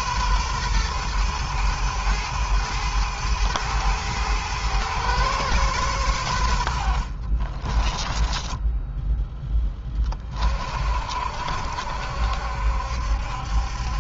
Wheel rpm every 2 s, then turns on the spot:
110, 110, 120, 60, 10, 50, 70.
6-10